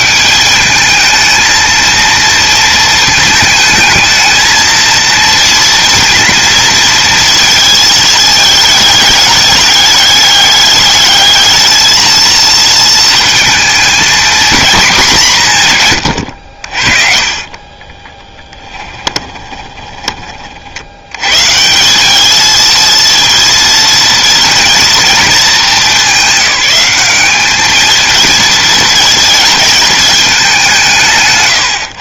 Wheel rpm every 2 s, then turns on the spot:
210, 220, 230, 230, 210, 210, 230, 210, 40, 20, 100, 230, 220, 200, 230, 170.
18-20